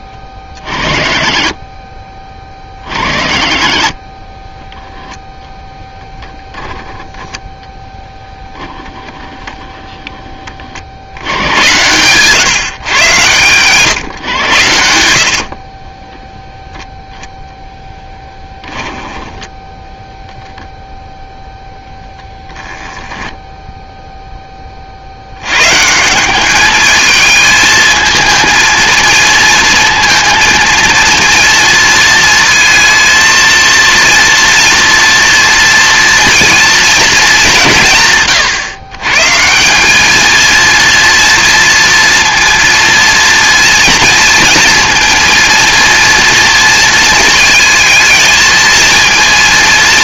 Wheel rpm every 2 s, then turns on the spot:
30, 40, 0, 10, 10, 50, 130, 80, 0, 10, 0, 0, 40, 210, 230, 230, 230, 230, 230, 130, 230, 230, 230, 230, 220.
none